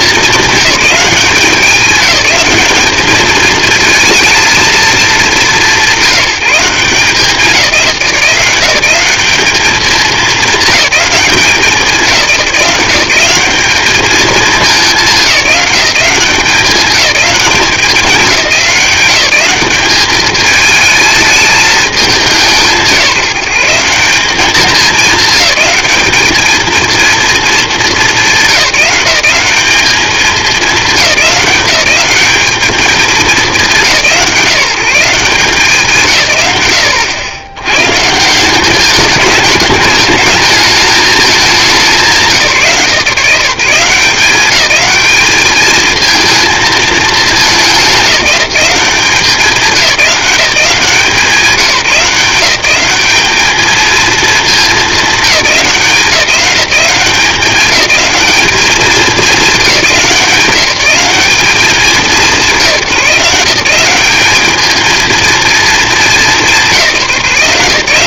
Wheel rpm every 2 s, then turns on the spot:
190, 210, 210, 170, 190, 210, 180, 200, 200, 190, 220, 170, 210, 230, 180, 210, 220, 180, 100, 200, 210, 180, 210, 220, 190, 180, 200, 200, 180, 210, 190, 160, 220, 180.
none